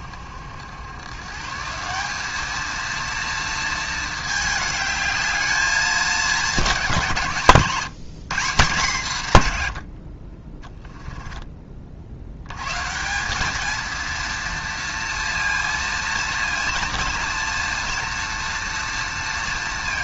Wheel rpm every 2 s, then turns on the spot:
90, 220, 210, 180, 170, 20, 120, 230, 230, 230.
10-12